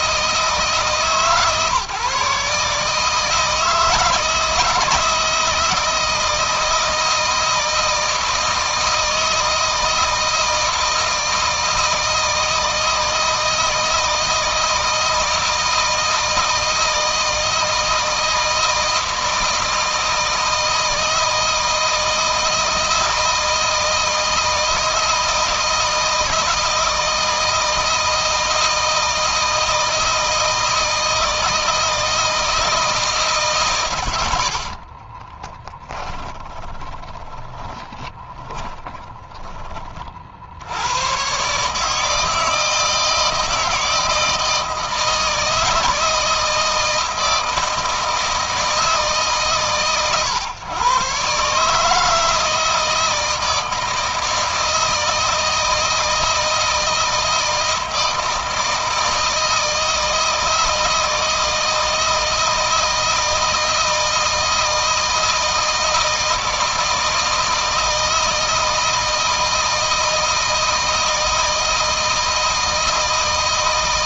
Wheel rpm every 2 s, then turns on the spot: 150, 150, 160, 160, 160, 160, 160, 160, 160, 160, 160, 160, 160, 160, 160, 160, 160, 50, 10, 20, 90, 160, 160, 160, 160, 130, 160, 160, 160, 160, 160, 160, 160, 160, 160, 160, 160.
34-40